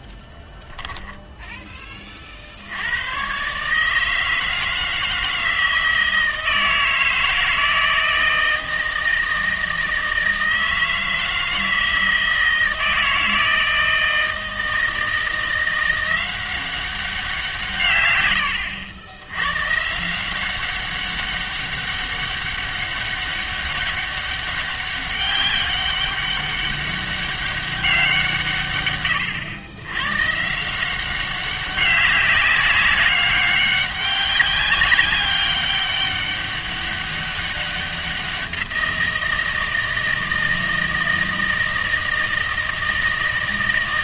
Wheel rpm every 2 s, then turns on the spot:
10, 80, 160, 160, 160, 160, 160, 160, 190, 90, 190, 200, 200, 200, 130, 170, 200, 200, 200, 170, 160, 160.
0-2